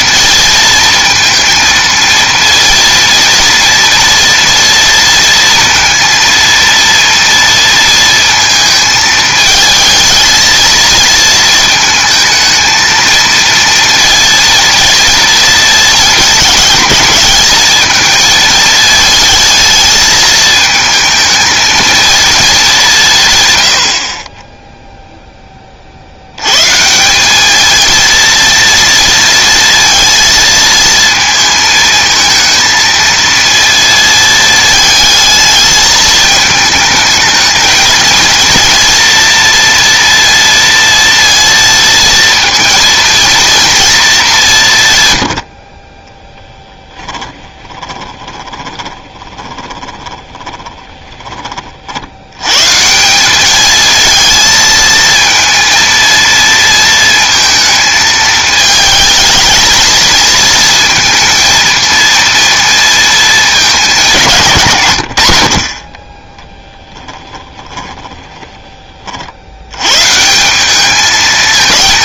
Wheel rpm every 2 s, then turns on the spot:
230, 230, 230, 230, 220, 230, 220, 230, 220, 220, 220, 180, 0, 150, 230, 220, 230, 220, 220, 230, 230, 230, 160, 10, 20, 20, 150, 220, 230, 220, 230, 230, 130, 10, 20, 190.
46-52 66-68